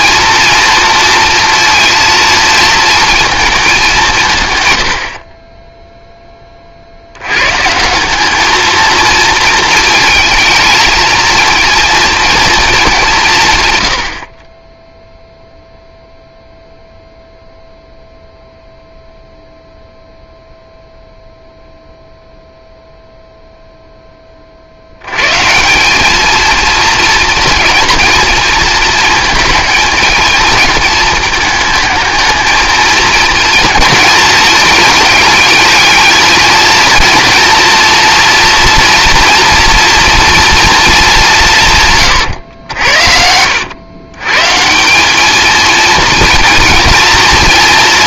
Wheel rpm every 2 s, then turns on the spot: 230, 220, 100, 50, 220, 220, 210, 10, 0, 0, 0, 0, 80, 230, 230, 220, 220, 220, 230, 230, 220, 80, 180, 230.
none